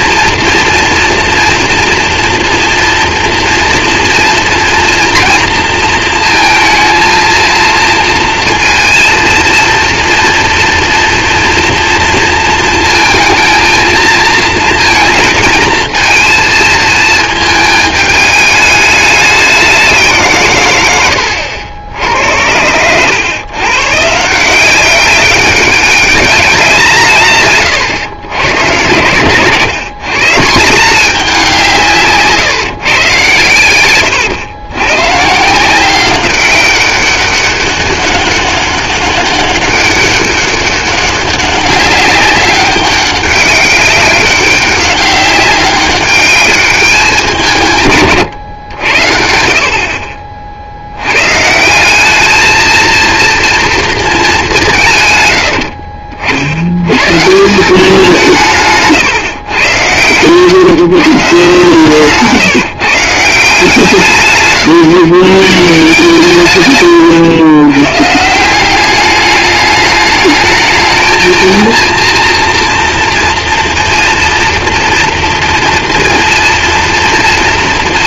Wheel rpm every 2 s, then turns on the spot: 230, 230, 230, 220, 230, 230, 230, 220, 230, 210, 120, 90, 180, 190, 120, 170, 130, 110, 190, 200, 200, 200, 190, 200, 110, 60, 220, 180, 70, 160, 140, 150, 130, 140, 180, 220, 230, 230, 230.
none